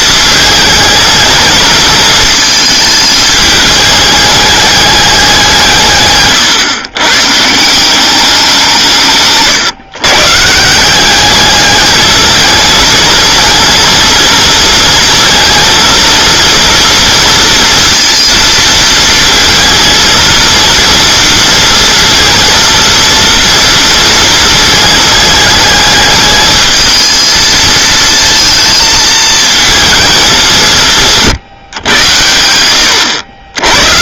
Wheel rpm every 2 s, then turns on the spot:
220, 220, 210, 120, 170, 170, 220, 230, 230, 230, 230, 230, 220, 220, 230, 170, 90.
none